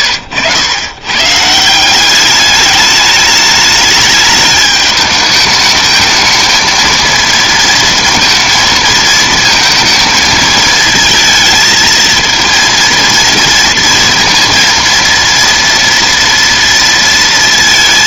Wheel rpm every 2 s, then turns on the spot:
100, 210, 210, 230, 230, 220, 230, 230, 230.
none